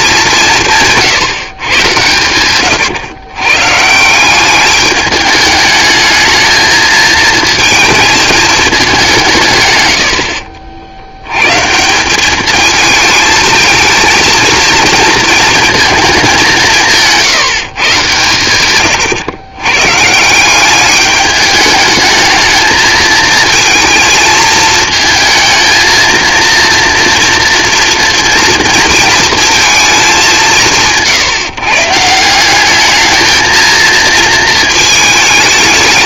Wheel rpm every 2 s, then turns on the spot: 150, 120, 200, 220, 200, 60, 220, 230, 160, 110, 200, 220, 220, 230, 230, 160, 210, 220.
18-20